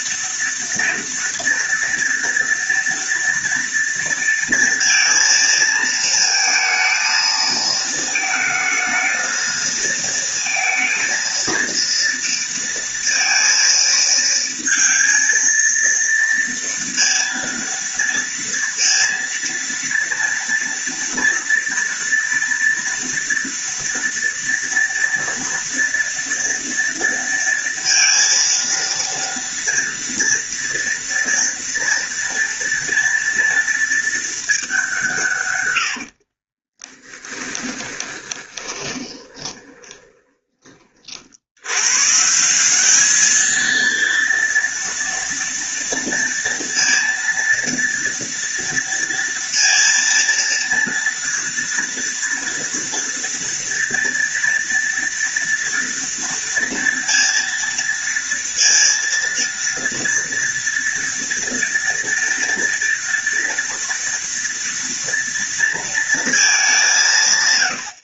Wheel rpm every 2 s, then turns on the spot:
240, 230, 230, 230, 220, 230, 230, 230, 230, 230, 230, 230, 230, 230, 230, 230, 230, 210, 30, 20, 30, 180, 230, 230, 230, 230, 230, 230, 230, 230, 230, 240, 230, 210.
36-40